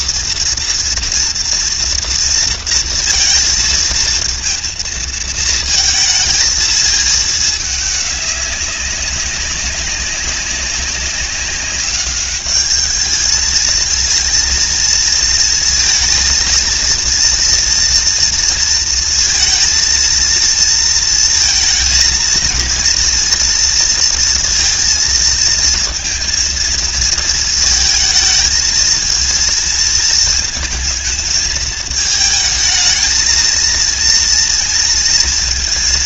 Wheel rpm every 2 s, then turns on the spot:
230, 220, 230, 220, 190, 200, 220, 230, 230, 230, 230, 230, 230, 230, 230, 220, 220, 230.
none